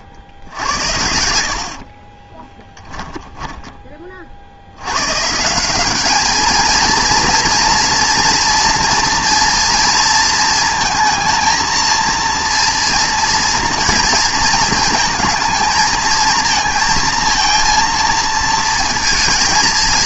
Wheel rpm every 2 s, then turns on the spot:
70, 10, 70, 220, 240, 230, 240, 230, 230, 230.
2-4